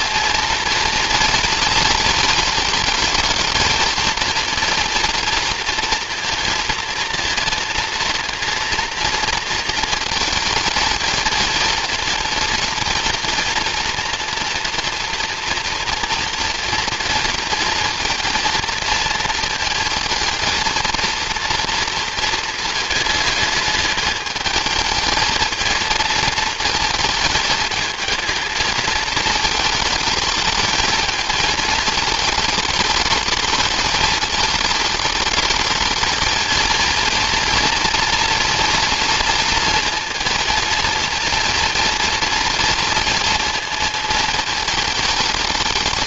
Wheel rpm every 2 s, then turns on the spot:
230, 220, 230, 230, 230, 220, 230, 240, 230, 230, 230, 220, 220, 220, 220, 220, 220, 210, 230, 240, 230, 230, 220.
none